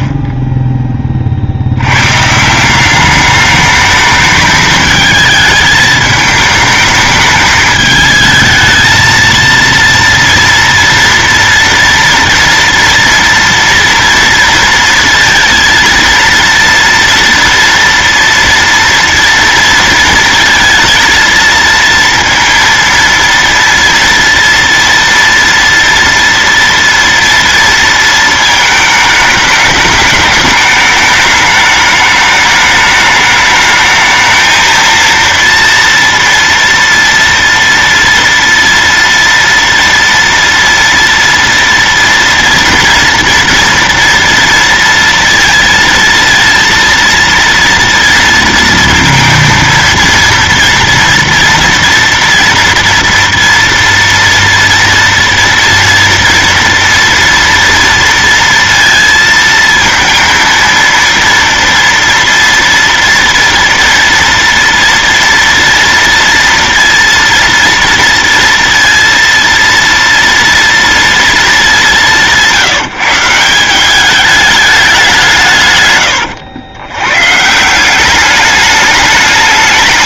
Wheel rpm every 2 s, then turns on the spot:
10, 160, 210, 220, 220, 230, 230, 230, 230, 230, 230, 230, 230, 230, 220, 210, 210, 220, 230, 230, 230, 230, 230, 230, 230, 230, 230, 230, 230, 230, 230, 230, 240, 230, 230, 230, 170, 210, 110, 210.
none